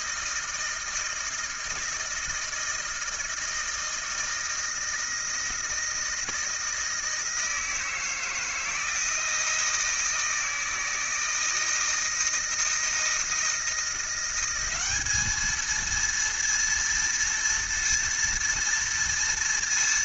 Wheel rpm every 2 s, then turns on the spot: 160, 160, 160, 160, 160, 160, 160, 200, 230, 230.
none